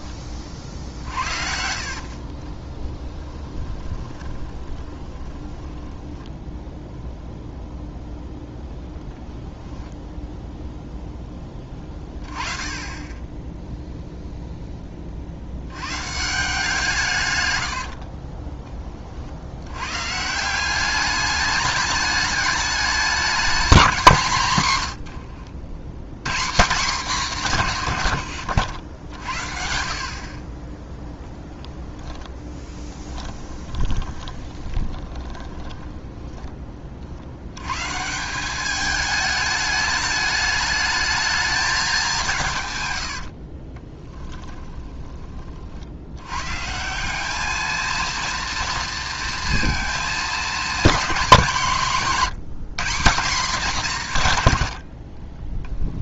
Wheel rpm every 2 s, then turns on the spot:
30, 20, 20, 0, 0, 0, 20, 10, 180, 40, 190, 200, 140, 180, 80, 0, 10, 20, 30, 200, 210, 140, 10, 160, 230, 220, 190, 90.
0-6 18-20 32-36 44-46